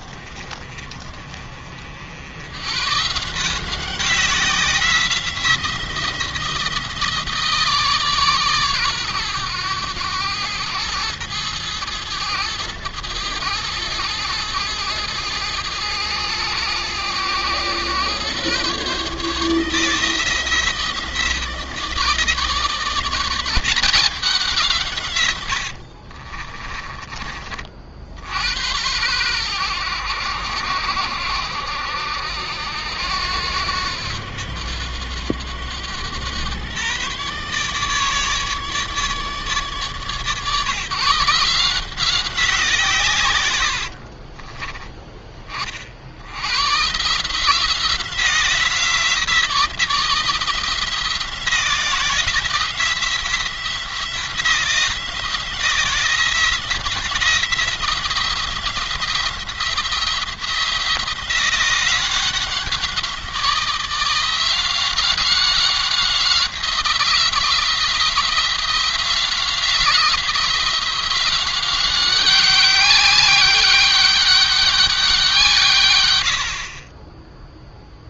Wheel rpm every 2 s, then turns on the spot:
40, 120, 180, 170, 130, 110, 110, 110, 100, 130, 170, 160, 170, 30, 90, 80, 80, 90, 130, 150, 150, 150, 20, 130, 170, 170, 170, 170, 170, 170, 170, 180, 180, 180, 170, 180, 200, 200, 50.
26-28